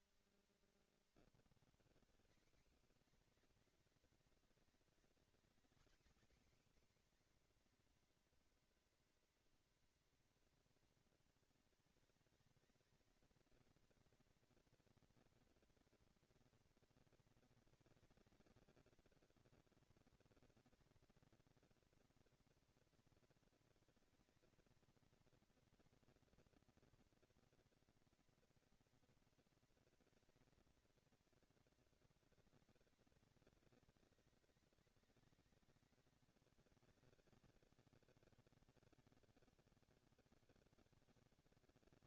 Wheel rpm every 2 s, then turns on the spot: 130, 230, 240, 270, 230, 190, 220, 230, 230, 230, 230, 230, 230, 230, 220, 220, 190, 200, 200, 200, 200.
none